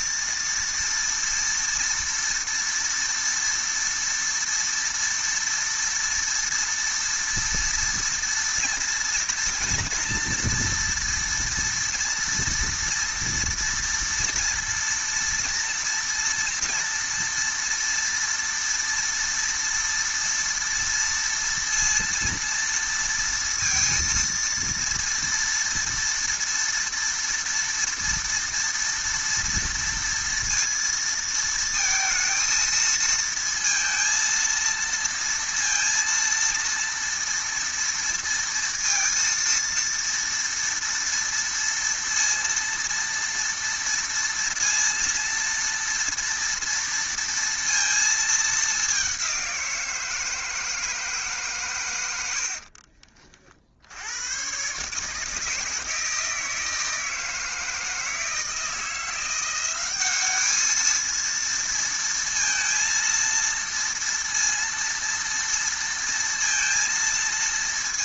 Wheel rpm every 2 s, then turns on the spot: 230, 230, 230, 230, 230, 230, 230, 230, 230, 230, 230, 230, 230, 230, 230, 230, 230, 230, 230, 230, 230, 230, 230, 230, 220, 160, 90, 110, 160, 160, 200, 230, 230, 230.
none